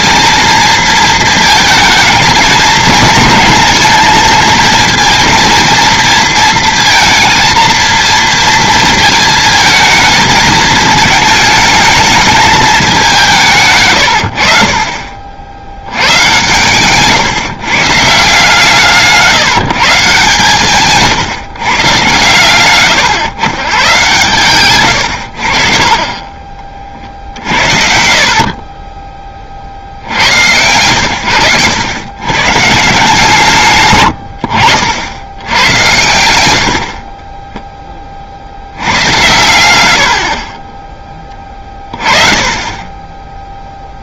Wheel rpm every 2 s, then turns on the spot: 230, 220, 230, 230, 230, 220, 220, 50, 120, 160, 130, 120, 120, 30, 40, 100, 140, 60, 80, 70, 20, 20.
28-30 36-38